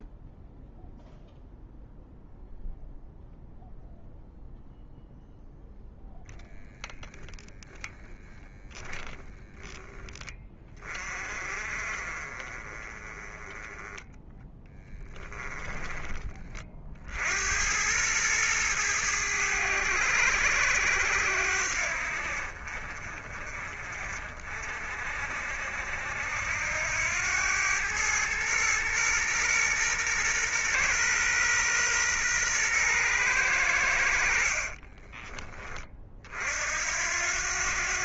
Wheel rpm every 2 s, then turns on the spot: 0, 0, 0, 0, 10, 30, 20, 10, 70, 100, 80, 40, 50, 100, 120, 120, 100, 30, 80.
none